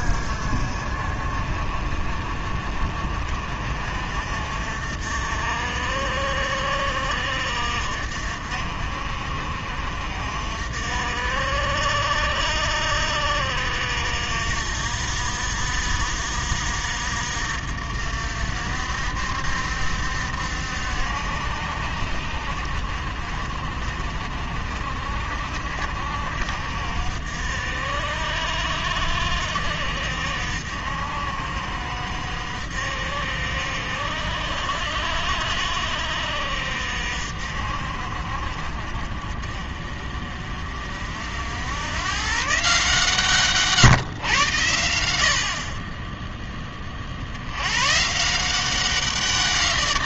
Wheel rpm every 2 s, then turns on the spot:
50, 50, 50, 50, 60, 60, 60, 60, 60, 60, 70, 50, 50, 60, 60, 60, 60, 60, 60, 50, 50, 140, 90, 20, 170.
none